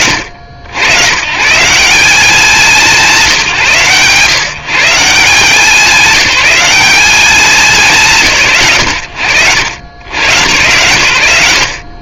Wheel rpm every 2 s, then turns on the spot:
100, 180, 150, 200, 90, 100.
none